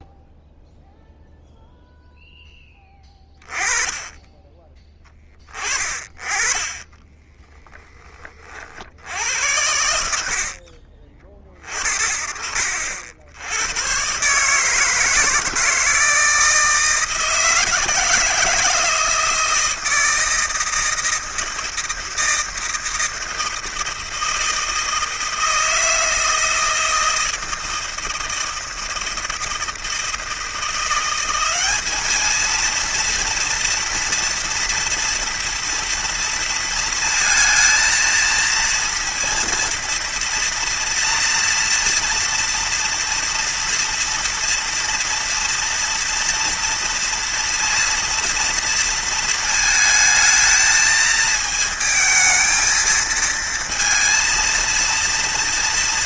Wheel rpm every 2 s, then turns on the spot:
0, 10, 20, 20, 50, 60, 60, 150, 160, 160, 160, 160, 160, 160, 160, 170, 230, 240, 230, 230, 230, 230, 230, 230, 230, 220, 220, 230.
none